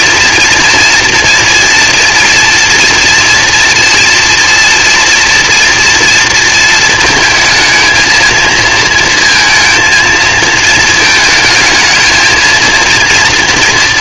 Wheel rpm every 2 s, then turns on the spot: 230, 230, 240, 220, 220, 220, 230.
none